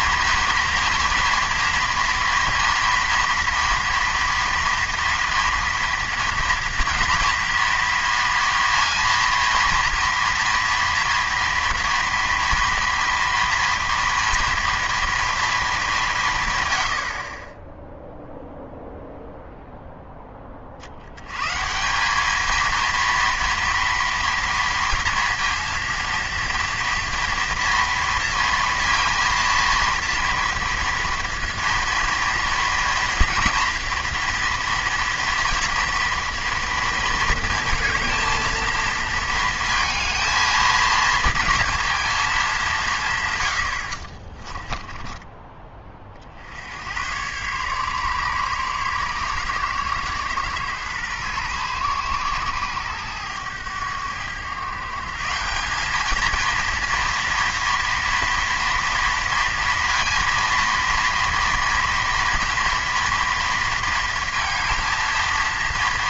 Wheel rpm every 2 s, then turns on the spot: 230, 230, 230, 240, 230, 230, 230, 230, 150, 0, 20, 220, 230, 230, 230, 230, 230, 230, 230, 230, 220, 210, 30, 50, 140, 120, 120, 110, 220, 240, 230, 230, 230.
44-46